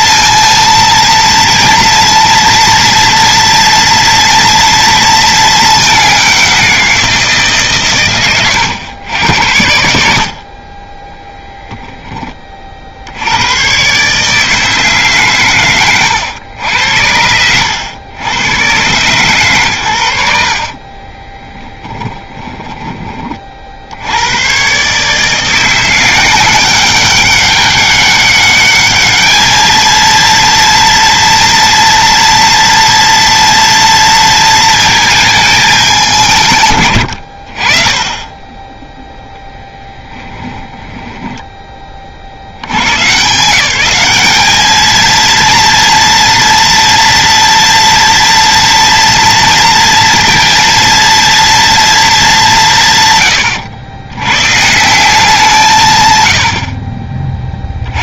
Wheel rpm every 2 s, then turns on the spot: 230, 230, 230, 180, 100, 20, 50, 150, 90, 120, 40, 20, 130, 190, 210, 230, 230, 220, 120, 10, 10, 110, 220, 230, 230, 230, 150, 160, 50.
10-12 20-22 40-42